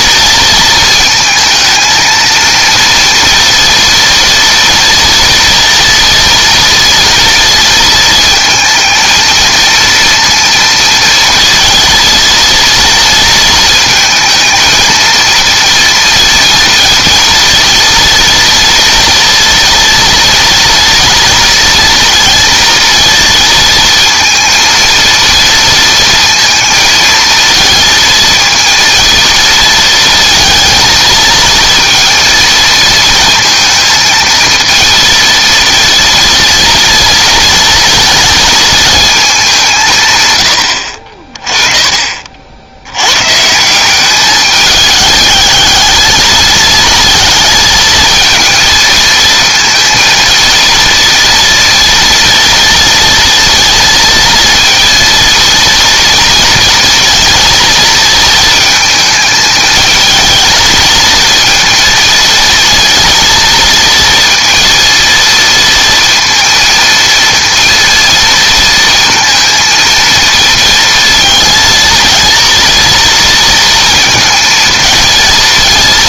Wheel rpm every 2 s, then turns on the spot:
230, 230, 240, 230, 230, 230, 230, 230, 230, 230, 230, 230, 230, 220, 230, 220, 230, 230, 230, 220, 70, 90, 210, 220, 230, 230, 230, 230, 230, 220, 220, 230, 230, 230, 230, 230, 230, 230.
none